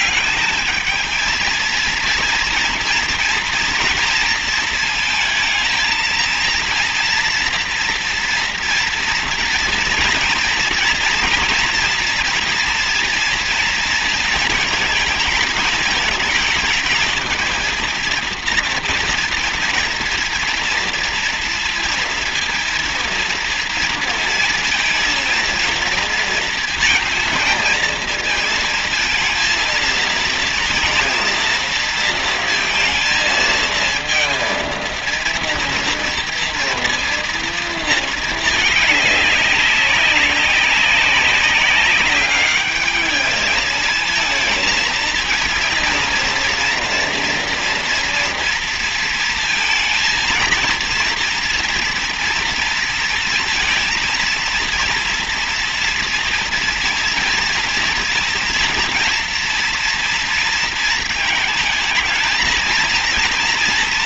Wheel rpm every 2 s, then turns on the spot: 210, 230, 230, 230, 230, 230, 230, 230, 220, 230, 230, 230, 230, 230, 230, 230, 230, 230, 230, 210, 200, 210, 230, 230, 230, 230, 230, 230, 230, 230, 230, 230.
none